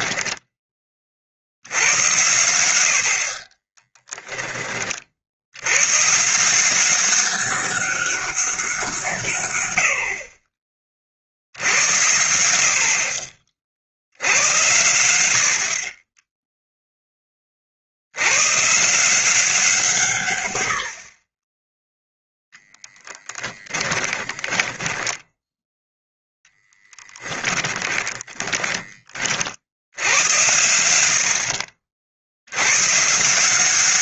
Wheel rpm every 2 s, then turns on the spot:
20, 90, 30, 190, 180, 40, 60, 90, 0, 140, 80, 10, 10, 10, 20, 80, 120.
22-26